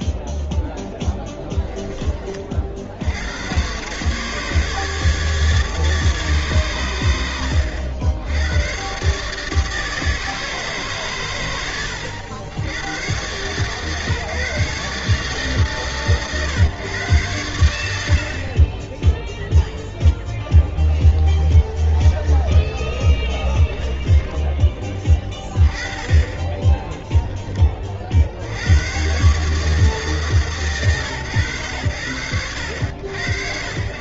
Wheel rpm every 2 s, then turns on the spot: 0, 60, 150, 130, 100, 150, 110, 150, 120, 30, 20, 30, 20, 30, 110, 130, 80.
20-24 26-28